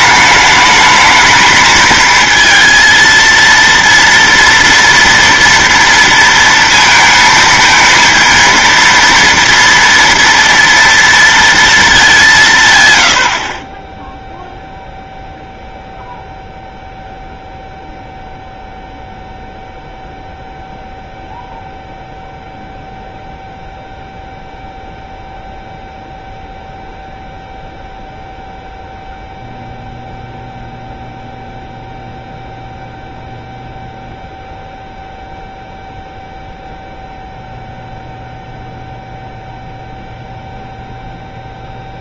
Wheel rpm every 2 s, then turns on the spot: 210, 230, 230, 230, 230, 230, 140, 0, 0, 0, 0, 0, 0, 0, 0, 0, 0, 0, 0, 0, 0.
none